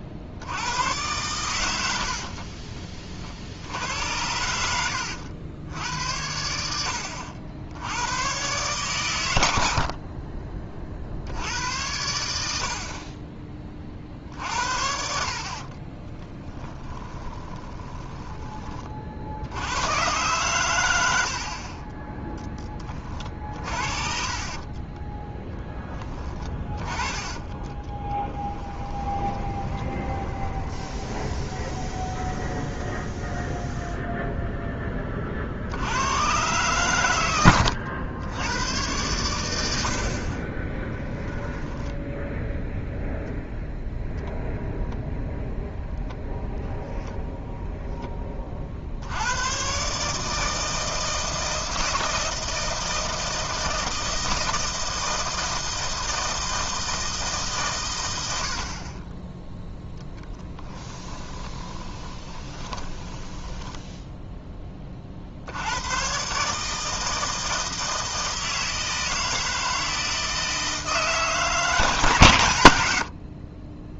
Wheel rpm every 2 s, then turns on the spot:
100, 40, 80, 80, 130, 40, 60, 60, 10, 30, 110, 20, 20, 10, 10, 20, 10, 10, 110, 110, 10, 0, 0, 0, 60, 160, 160, 160, 160, 40, 10, 10, 30, 160, 160, 160, 80.
2-6 16-18 24-26 28-34 40-42 60-64